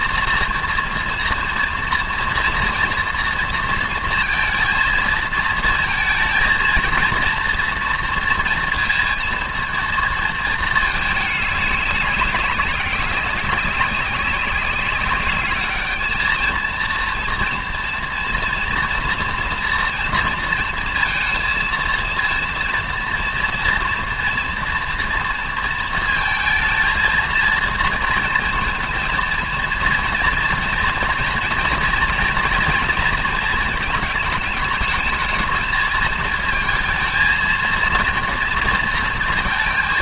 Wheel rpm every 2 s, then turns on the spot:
230, 240, 230, 230, 230, 220, 200, 190, 220, 230, 230, 230, 230, 230, 230, 230, 220, 220, 220, 230.
none